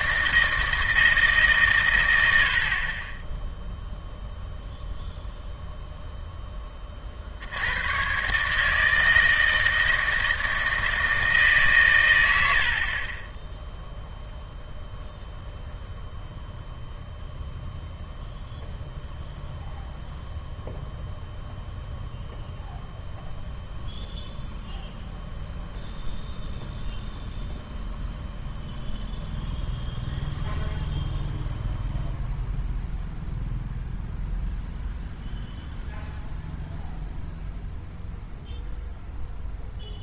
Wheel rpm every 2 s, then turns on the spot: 160, 80, 0, 10, 150, 160, 60, 0, 0, 0, 0, 0, 0, 0, 0, 0, 0, 0, 0, 0.
none